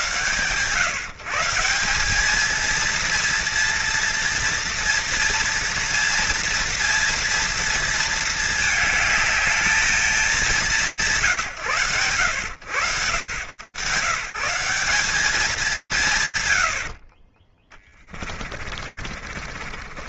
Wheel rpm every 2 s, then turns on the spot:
150, 230, 230, 230, 210, 170, 100, 190, 40, 40.
18-20